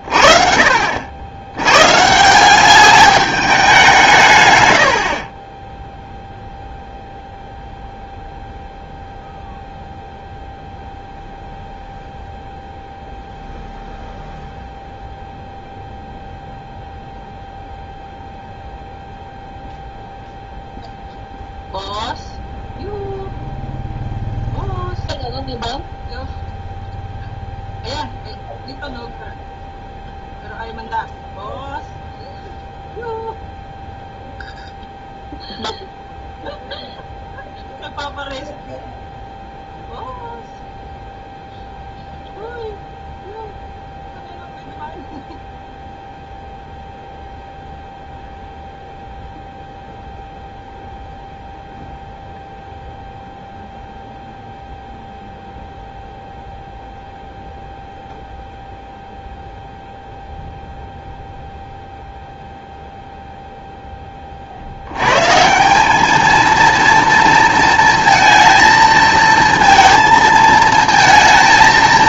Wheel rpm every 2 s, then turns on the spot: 50, 190, 100, 0, 0, 0, 0, 0, 0, 0, 0, 0, 0, 0, 0, 0, 0, 0, 0, 0, 0, 0, 0, 0, 0, 0, 0, 0, 0, 0, 0, 0, 70, 230, 230, 230.
4-6